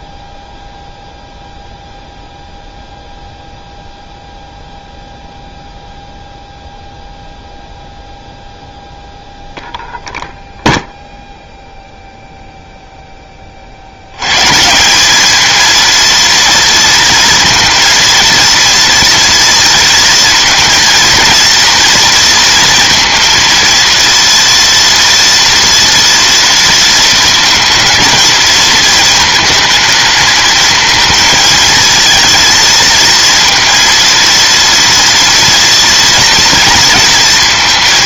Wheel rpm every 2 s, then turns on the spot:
0, 0, 0, 0, 0, 0, 0, 160, 230, 230, 230, 230, 230, 230, 220, 230, 230, 230, 230.
none